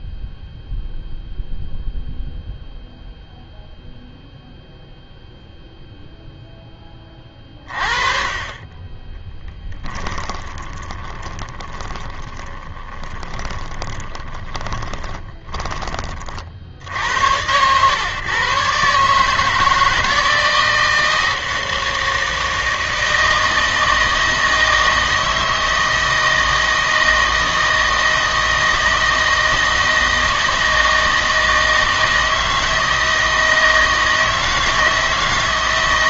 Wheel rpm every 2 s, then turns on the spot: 0, 0, 0, 10, 20, 20, 20, 20, 60, 140, 170, 160, 160, 160, 160, 160, 160, 160.
10-16